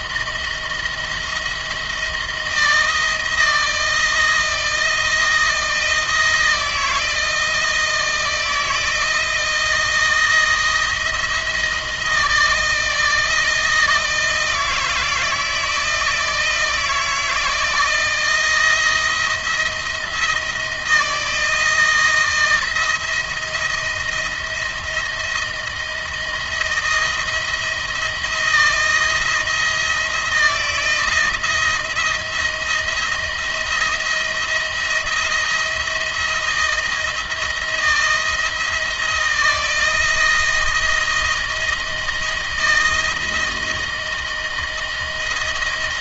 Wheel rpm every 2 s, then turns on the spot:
170, 160, 160, 160, 170, 170, 160, 160, 160, 170, 160, 170, 160, 160, 170, 170, 170, 170, 170, 170, 160, 170, 160.
none